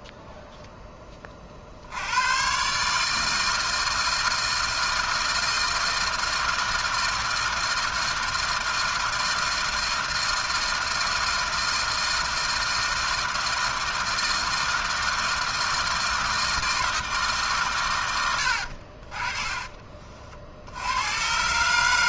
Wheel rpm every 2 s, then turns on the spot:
60, 160, 160, 160, 160, 160, 160, 160, 130, 30, 130.
18-20